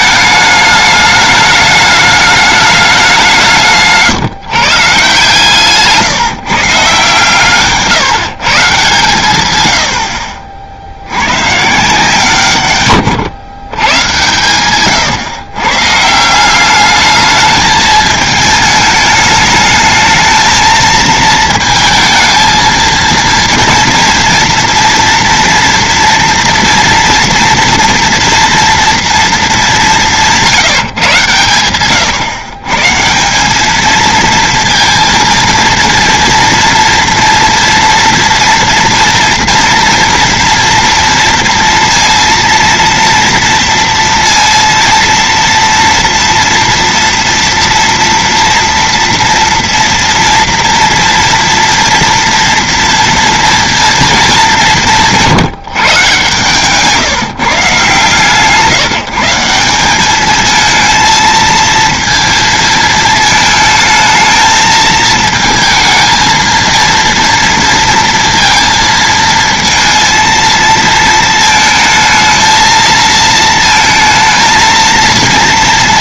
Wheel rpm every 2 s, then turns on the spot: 210, 210, 140, 150, 160, 30, 150, 110, 160, 220, 220, 220, 230, 230, 240, 180, 120, 220, 230, 230, 230, 230, 230, 230, 230, 230, 230, 220, 140, 140, 200, 230, 220, 230, 230, 230, 220, 230.
none